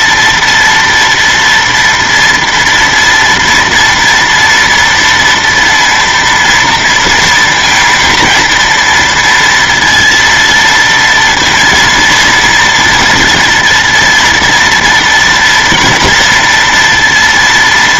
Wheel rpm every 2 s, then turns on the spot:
230, 230, 230, 230, 230, 230, 230, 230, 240.
none